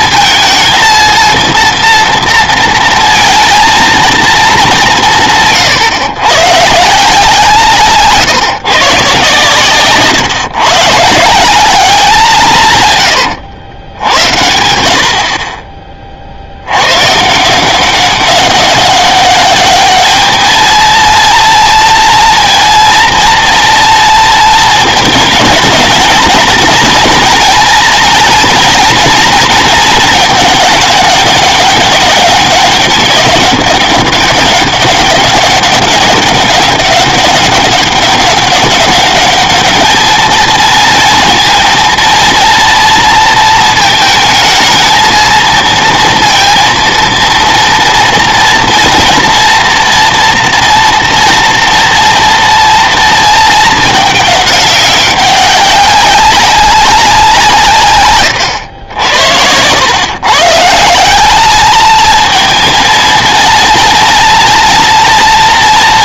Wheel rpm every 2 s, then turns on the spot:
230, 230, 190, 150, 140, 140, 140, 80, 90, 200, 230, 230, 230, 230, 240, 210, 200, 200, 200, 190, 230, 230, 220, 230, 240, 230, 230, 190, 190, 110, 160, 220, 230.
none